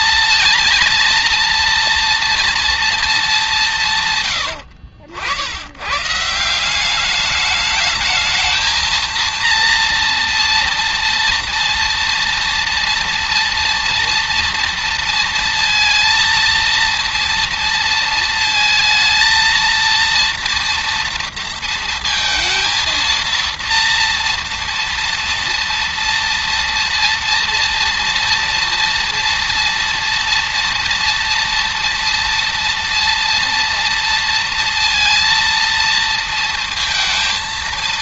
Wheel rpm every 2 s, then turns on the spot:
230, 210, 70, 190, 230, 240, 240, 230, 230, 230, 230, 230, 230, 230, 230, 230, 230, 230, 230.
none